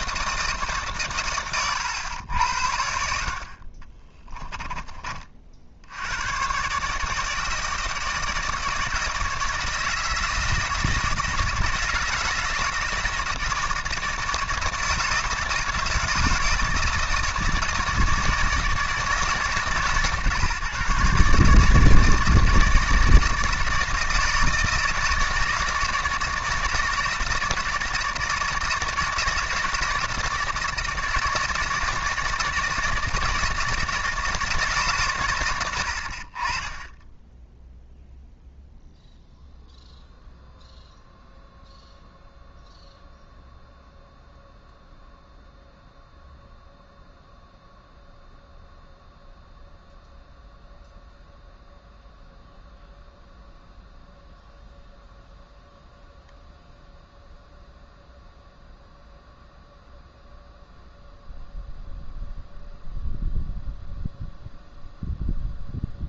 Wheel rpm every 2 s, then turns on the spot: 150, 70, 20, 140, 160, 160, 160, 160, 160, 160, 140, 160, 160, 160, 160, 160, 160, 140, 20, 0, 0, 0, 0, 0, 0, 0, 0, 0, 0, 0, 0, 0, 0.
none